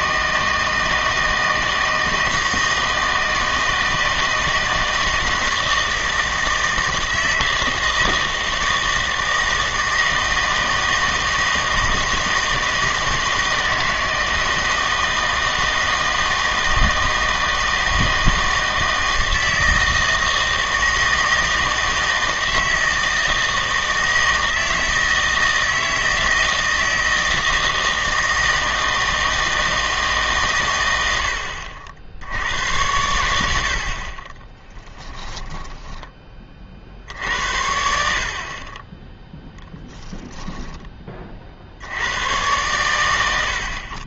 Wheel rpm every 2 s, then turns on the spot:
160, 160, 160, 160, 160, 160, 160, 160, 160, 160, 160, 160, 160, 160, 160, 120, 90, 20, 40, 40, 10, 110.
34-36 40-42